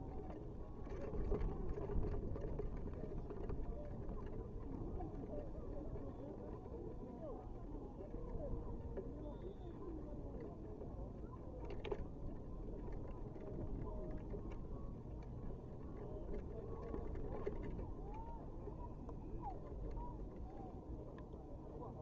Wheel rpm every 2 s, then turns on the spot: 0, 0, 0, 0, 0, 0, 0, 0, 0, 0, 0.
none